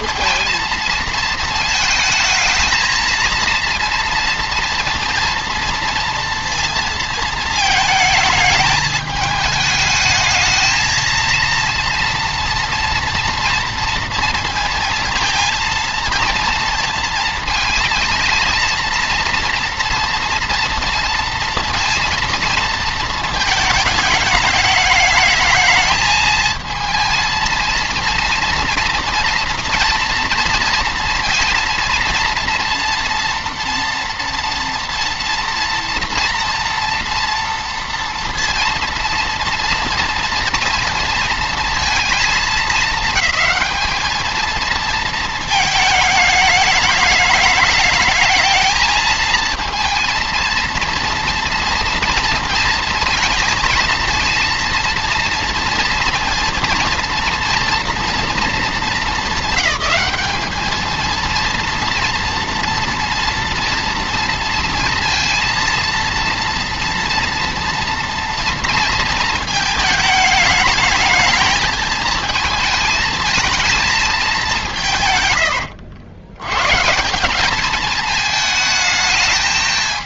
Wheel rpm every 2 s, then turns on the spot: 230, 220, 230, 230, 210, 220, 230, 230, 230, 230, 230, 230, 210, 220, 230, 230, 230, 240, 230, 230, 230, 220, 230, 210, 220, 230, 220, 230, 230, 220, 220, 240, 230, 230, 230, 210, 220, 180, 120, 220.
none